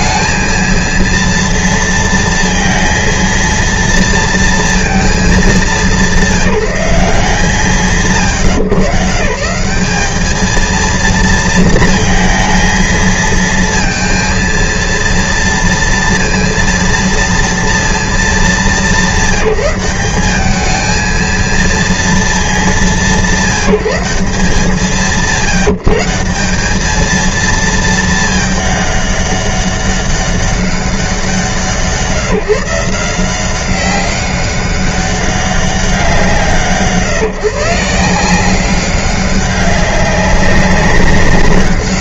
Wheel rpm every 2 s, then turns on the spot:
230, 230, 230, 170, 120, 220, 230, 230, 230, 190, 210, 200, 160, 190, 210, 190, 160, 200, 150, 190, 180.
none